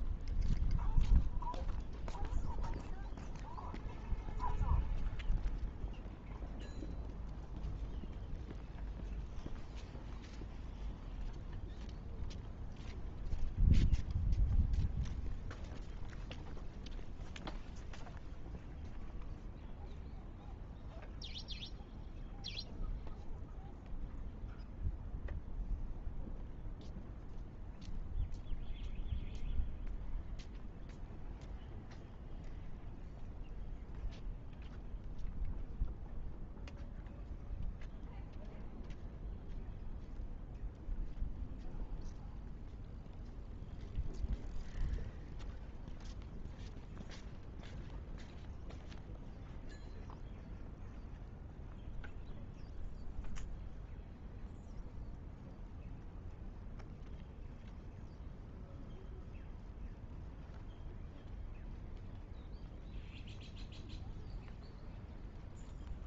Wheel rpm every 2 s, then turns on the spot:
0, 0, 0, 0, 0, 0, 0, 0, 0, 0, 0, 0, 0, 0, 0, 0, 0, 0, 0, 0, 0, 0, 0, 0, 0, 0, 0, 0, 0, 0, 0, 0, 0.
none